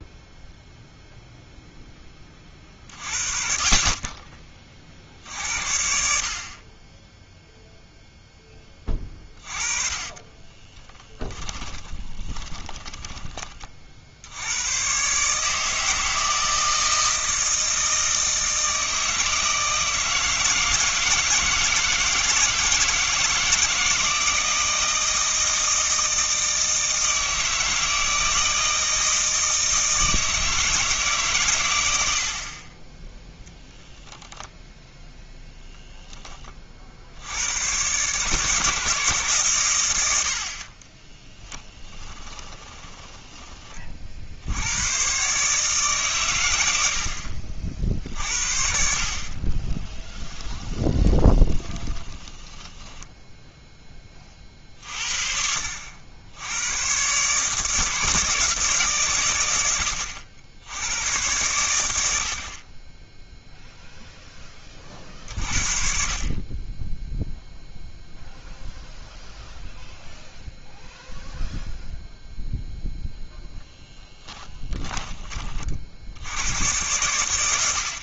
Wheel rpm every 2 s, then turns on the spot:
0, 40, 50, 20, 20, 20, 20, 120, 160, 160, 160, 160, 160, 160, 160, 160, 30, 0, 50, 150, 30, 20, 90, 90, 50, 10, 10, 50, 120, 150, 90, 20, 30, 20, 0, 0, 0, 20, 100.
10-14 40-44 50-54 74-76